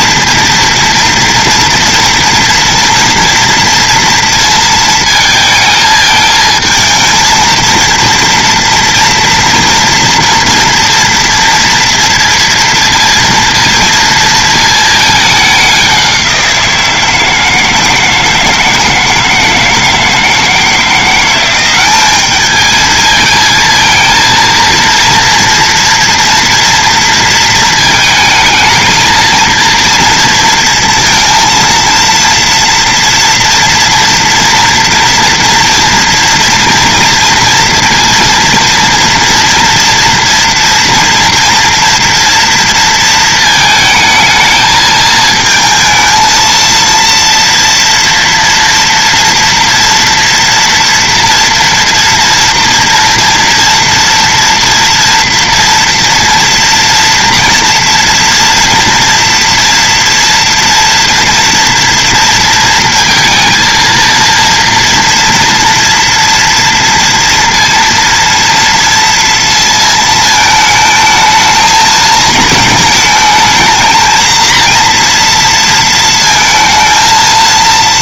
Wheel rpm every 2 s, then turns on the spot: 230, 230, 220, 220, 230, 230, 230, 220, 170, 160, 170, 220, 230, 230, 220, 230, 230, 230, 230, 230, 230, 230, 220, 230, 230, 230, 230, 240, 230, 230, 230, 230, 230, 230, 230, 220, 220, 230, 230.
none